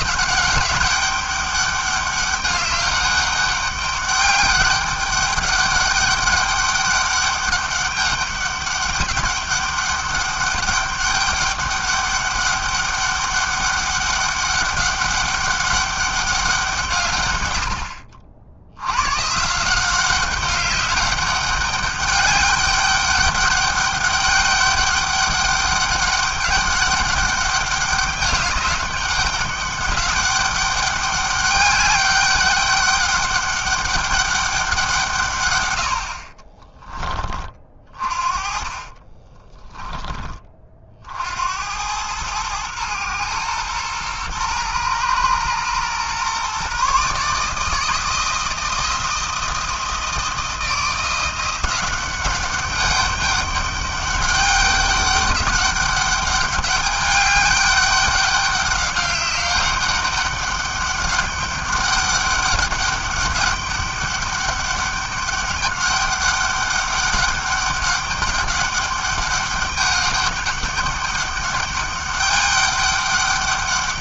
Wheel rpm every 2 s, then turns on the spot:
190, 200, 200, 200, 200, 200, 200, 200, 170, 90, 200, 200, 200, 200, 200, 200, 200, 180, 30, 30, 50, 120, 120, 140, 170, 170, 200, 200, 200, 200, 200, 200, 200, 200, 200, 200, 200.
38-40